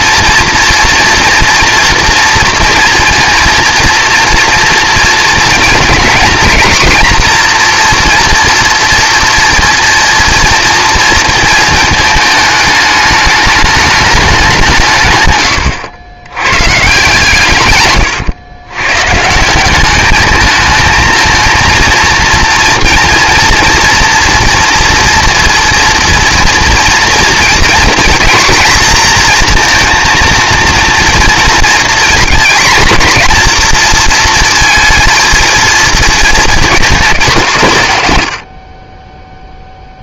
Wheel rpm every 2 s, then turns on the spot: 230, 230, 230, 240, 230, 230, 210, 180, 120, 110, 220, 230, 230, 230, 230, 230, 240, 230, 220, 60.
none